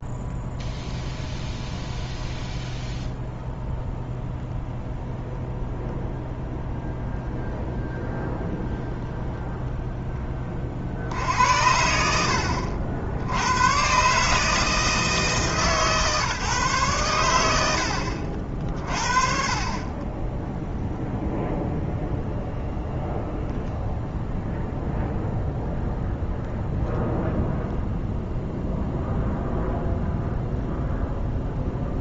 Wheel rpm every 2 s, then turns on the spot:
0, 0, 0, 0, 0, 40, 70, 160, 130, 50, 10, 0, 0, 0, 0, 0.
none